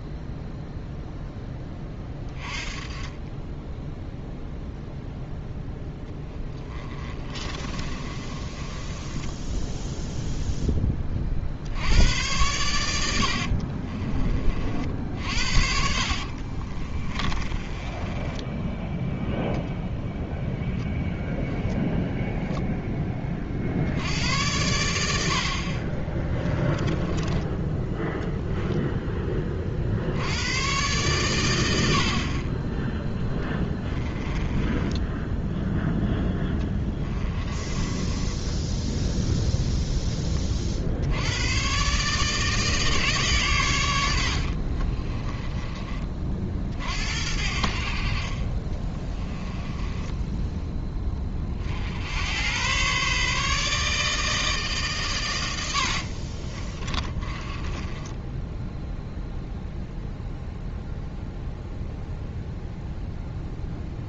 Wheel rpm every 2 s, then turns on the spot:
0, 20, 0, 10, 20, 10, 100, 50, 30, 10, 0, 0, 90, 20, 0, 100, 20, 10, 10, 10, 50, 150, 50, 50, 40, 10, 110, 150, 30, 10, 0, 0.
6-10 16-20 26-28 34-40 44-46 48-50 56-58